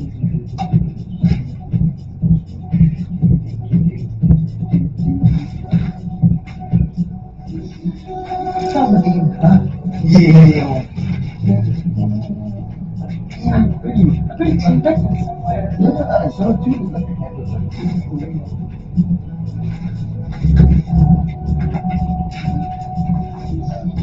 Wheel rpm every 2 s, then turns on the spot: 0, 0, 0, 0, 0, 0, 0, 0, 0, 0, 0, 0.
none